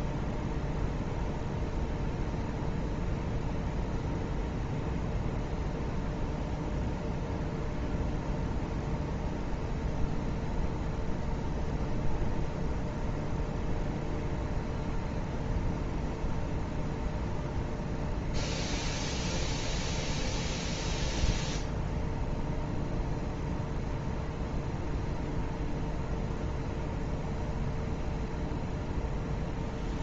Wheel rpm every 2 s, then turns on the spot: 0, 0, 0, 0, 0, 0, 0, 0, 0, 0, 0, 0, 0, 0, 0.
none